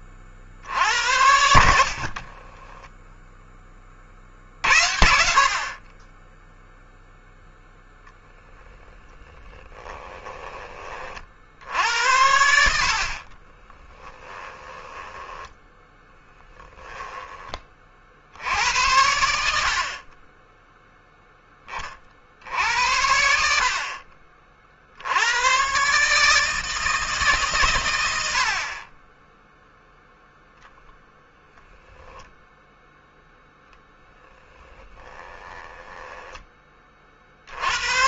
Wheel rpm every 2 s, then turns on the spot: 60, 10, 60, 0, 10, 20, 60, 10, 10, 80, 10, 70, 70, 160, 50, 0, 0, 10, 20.
2-4 14-16 34-36